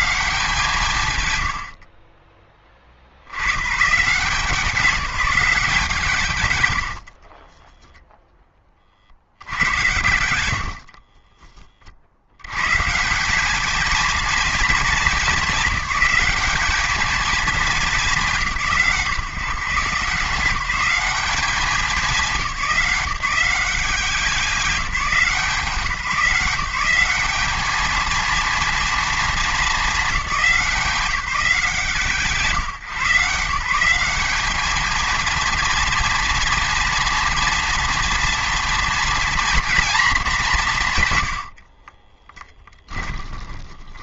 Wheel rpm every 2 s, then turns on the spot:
140, 20, 180, 110, 20, 70, 130, 210, 210, 170, 180, 190, 190, 190, 230, 180, 150, 210, 230, 230, 160, 20.
42-44